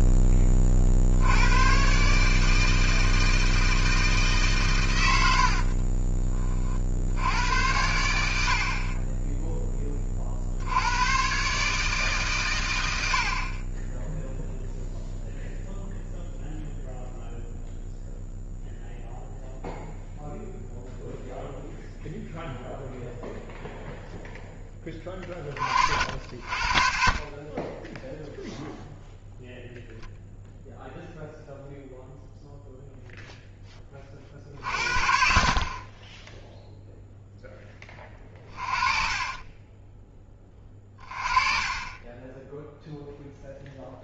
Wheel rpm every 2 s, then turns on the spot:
40, 160, 130, 40, 60, 80, 110, 0, 0, 0, 0, 0, 20, 40, 0, 0, 0, 40, 0, 30, 20, 0.
38-40